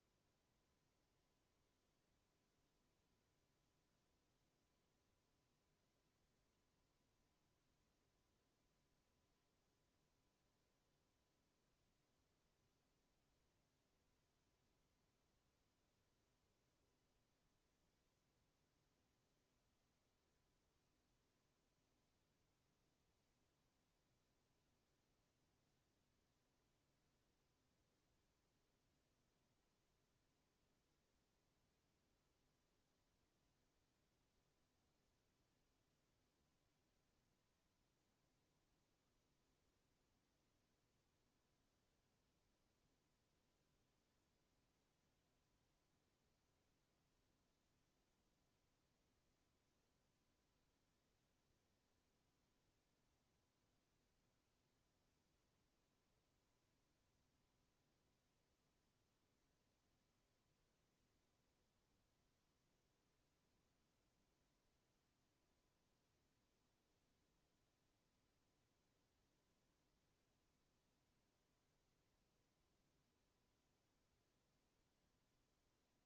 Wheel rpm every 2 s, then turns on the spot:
0, 0, 0, 0, 0, 0, 0, 0, 0, 0, 0, 0, 0, 0, 0, 0, 0, 0, 0, 0, 0, 0, 0, 0, 0, 0, 0, 0, 0, 0, 0, 0, 0, 0, 0, 0, 0, 0.
none